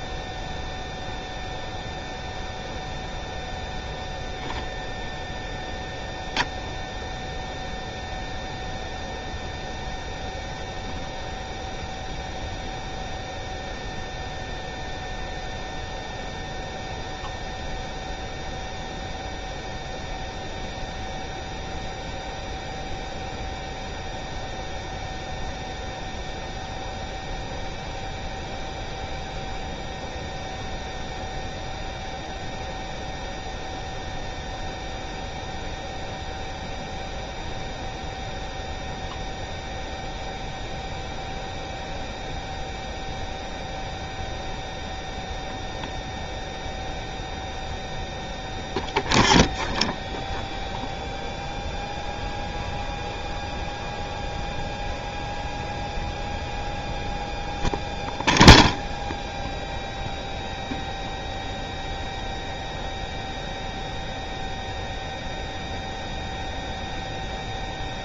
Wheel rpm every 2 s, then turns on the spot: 0, 0, 0, 0, 0, 0, 0, 0, 0, 0, 0, 0, 0, 0, 0, 0, 0, 0, 0, 0, 0, 0, 0, 0, 0, 0, 0, 0, 0, 0, 0, 0, 0, 0.
none